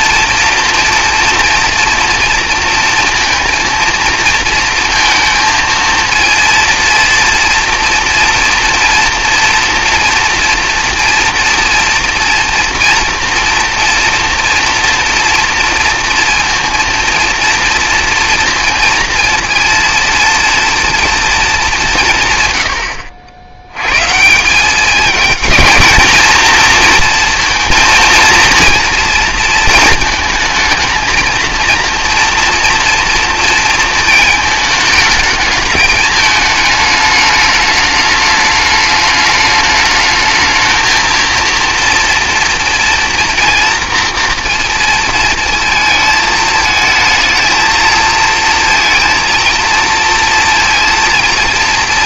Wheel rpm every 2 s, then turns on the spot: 240, 230, 230, 230, 230, 230, 230, 230, 230, 230, 230, 100, 210, 230, 230, 220, 230, 220, 210, 210, 220, 230, 230, 220, 230, 230.
none